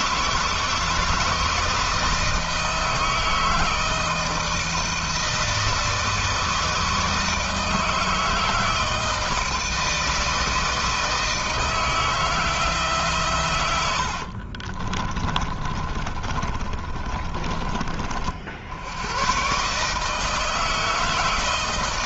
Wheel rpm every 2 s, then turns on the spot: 160, 160, 160, 160, 160, 160, 140, 30, 30, 110, 160.
14-18